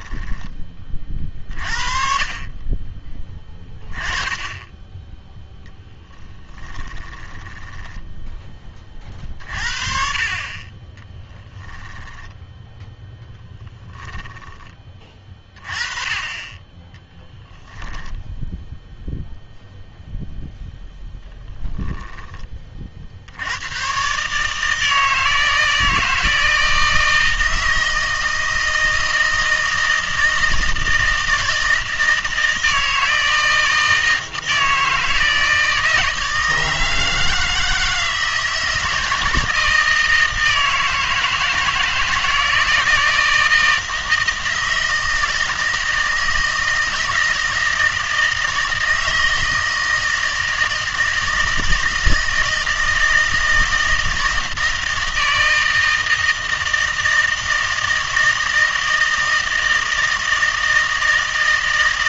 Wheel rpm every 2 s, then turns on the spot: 30, 30, 10, 10, 30, 20, 10, 20, 10, 0, 0, 30, 160, 160, 160, 160, 160, 160, 160, 160, 160, 160, 160, 160, 160, 160, 160, 160, 160, 160, 160.
6-8